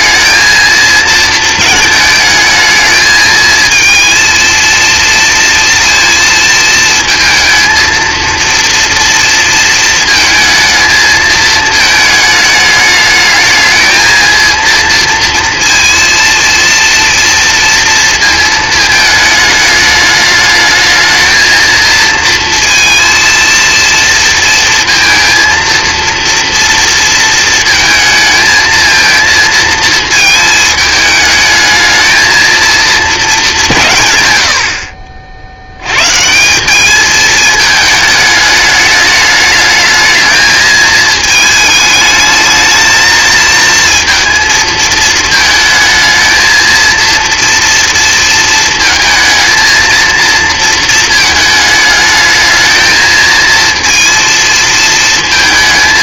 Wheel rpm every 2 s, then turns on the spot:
220, 220, 230, 230, 230, 220, 210, 230, 230, 220, 210, 230, 230, 230, 220, 220, 220, 90, 190, 210, 220, 220, 220, 230, 230, 230, 220, 230.
none